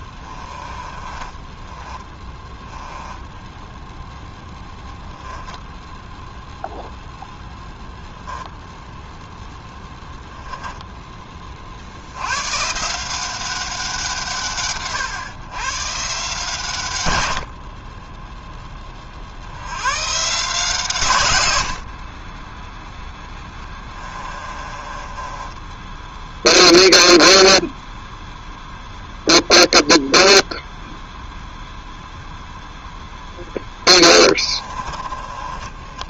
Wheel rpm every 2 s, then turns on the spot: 10, 0, 0, 0, 10, 100, 150, 140, 10, 130, 30, 20, 0, 0, 0, 0, 20, 0.
0-2 22-24 32-34